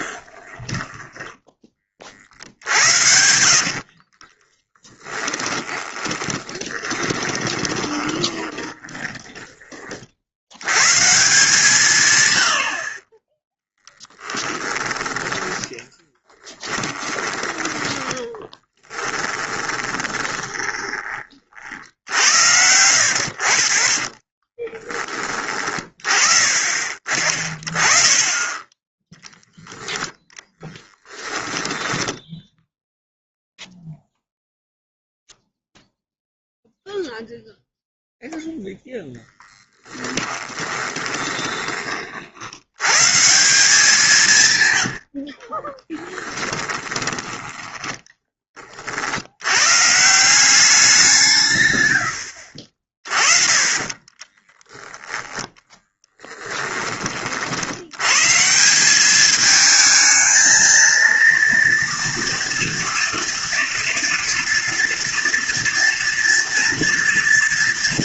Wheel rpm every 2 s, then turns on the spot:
10, 70, 10, 10, 20, 110, 70, 10, 20, 10, 30, 90, 20, 40, 20, 10, 0, 0, 0, 0, 20, 100, 130, 10, 30, 180, 50, 10, 10, 170, 230, 230, 230, 230.
0-10 16-22 24-26 40-42 44-48